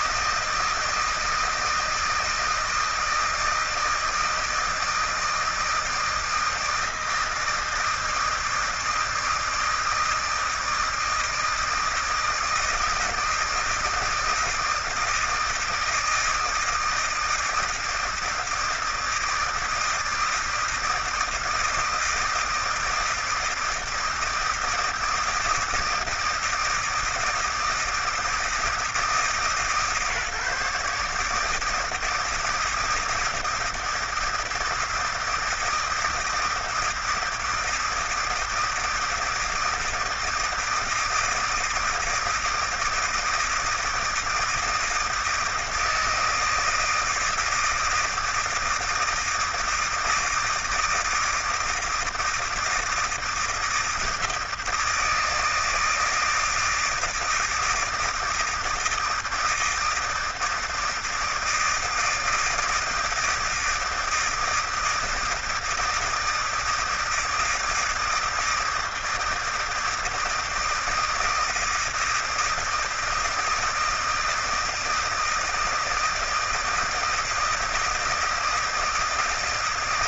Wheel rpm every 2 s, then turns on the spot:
160, 160, 160, 160, 160, 160, 160, 160, 160, 160, 160, 160, 160, 160, 160, 150, 160, 160, 160, 160, 160, 160, 160, 160, 170, 160, 160, 160, 160, 160, 160, 160, 160, 160, 160, 160, 160, 160, 170, 160.
none